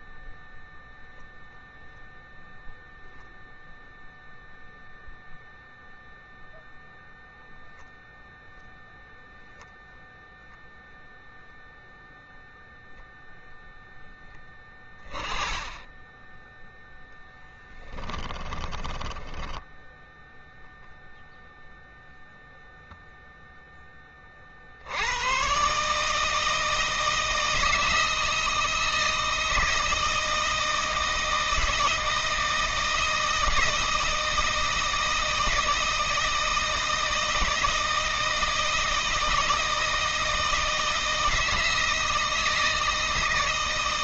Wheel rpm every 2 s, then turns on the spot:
0, 0, 0, 0, 0, 0, 0, 20, 10, 20, 0, 0, 60, 160, 160, 160, 160, 160, 160, 160, 160, 160.
18-20